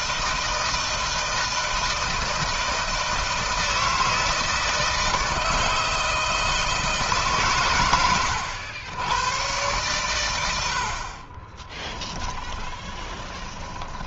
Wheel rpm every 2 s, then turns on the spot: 160, 160, 160, 160, 90, 90, 10.
12-14